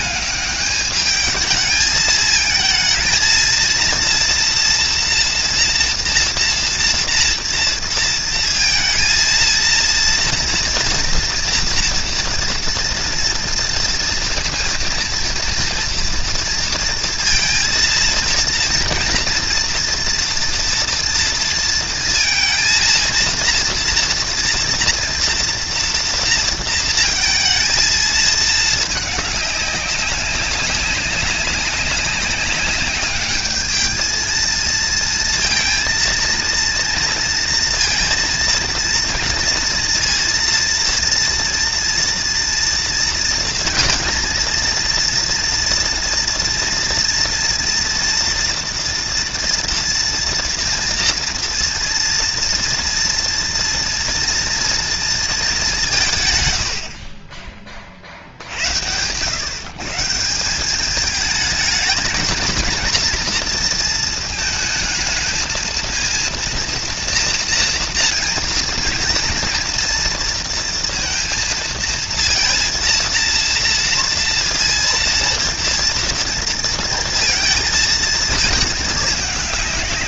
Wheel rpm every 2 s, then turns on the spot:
210, 220, 230, 230, 230, 240, 230, 230, 230, 230, 230, 230, 230, 230, 210, 190, 200, 230, 230, 230, 230, 230, 230, 230, 230, 240, 230, 230, 100, 80, 200, 230, 230, 230, 230, 230, 230, 230, 230, 220.
none